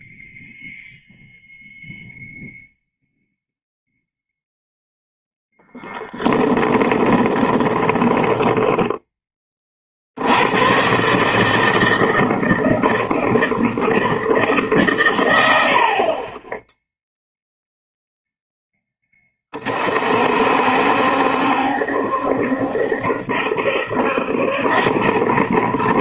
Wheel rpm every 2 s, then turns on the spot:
0, 0, 0, 20, 10, 120, 160, 140, 10, 10, 60, 70, 90.
6-10